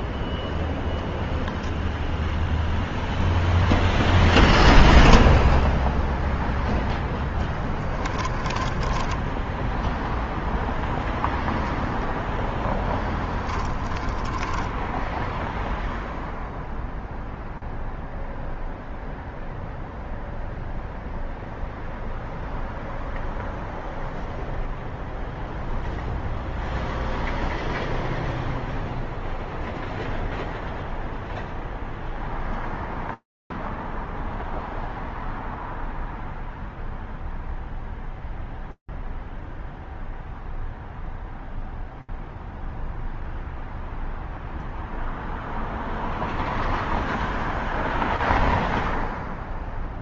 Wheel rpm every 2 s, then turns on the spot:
0, 0, 0, 0, 20, 0, 10, 10, 0, 0, 0, 0, 0, 0, 0, 0, 0, 0, 0, 0, 0, 0, 0, 0, 0.
8-10 14-16